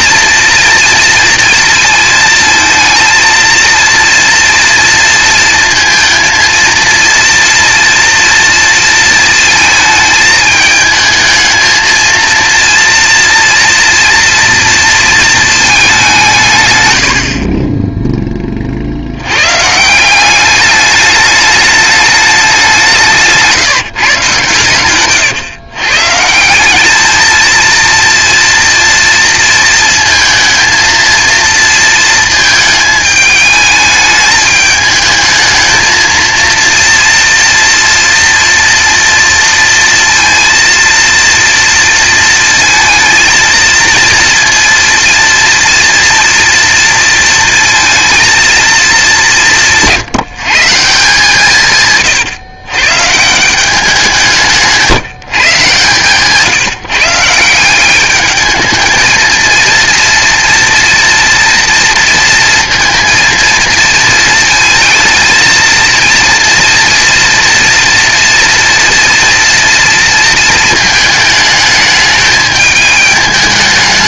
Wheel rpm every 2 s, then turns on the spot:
230, 220, 240, 230, 230, 220, 230, 230, 130, 30, 200, 200, 140, 180, 230, 230, 220, 210, 230, 230, 230, 220, 230, 230, 230, 160, 120, 160, 150, 210, 230, 230, 230, 230, 230, 220, 210.
none